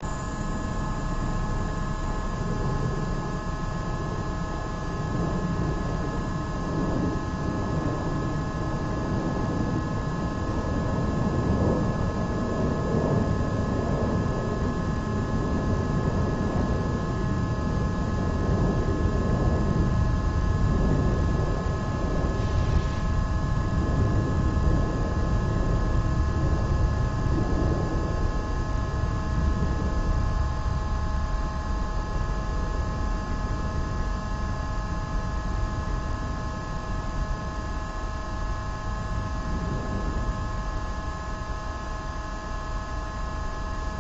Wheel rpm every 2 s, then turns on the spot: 0, 0, 0, 0, 0, 0, 0, 0, 0, 0, 0, 0, 0, 0, 0, 0, 0, 0, 0, 0, 0, 0.
none